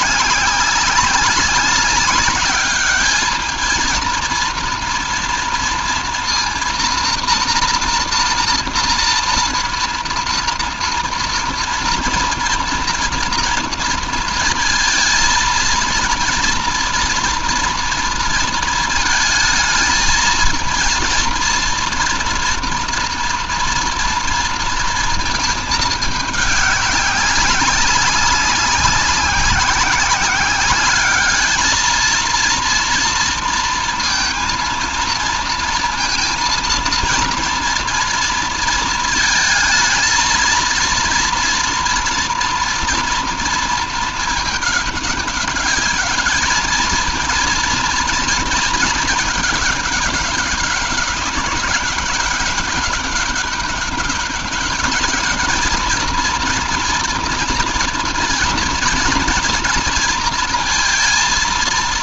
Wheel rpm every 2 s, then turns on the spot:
190, 210, 230, 240, 230, 230, 230, 220, 230, 220, 230, 230, 230, 200, 190, 210, 230, 230, 230, 220, 230, 230, 210, 220, 220, 190, 200, 210, 230, 230, 230.
none